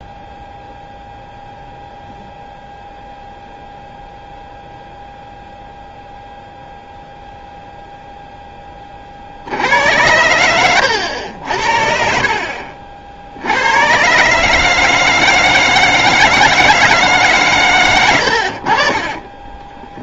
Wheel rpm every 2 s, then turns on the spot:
0, 0, 0, 0, 10, 100, 50, 150, 160, 60.
none